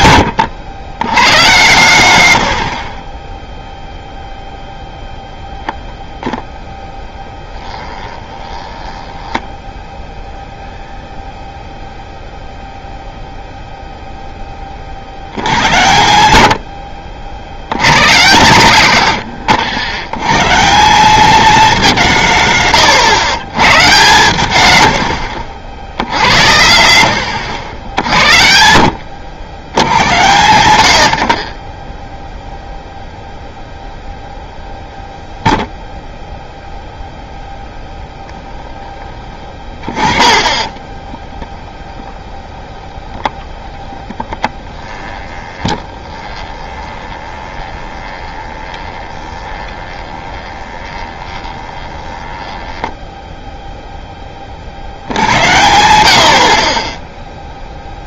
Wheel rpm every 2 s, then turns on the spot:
100, 90, 0, 0, 20, 0, 0, 20, 70, 140, 150, 150, 130, 100, 70, 110, 0, 0, 0, 10, 30, 20, 10, 20, 20, 20, 10, 50, 50.
8-10 22-24 28-30 38-40 42-54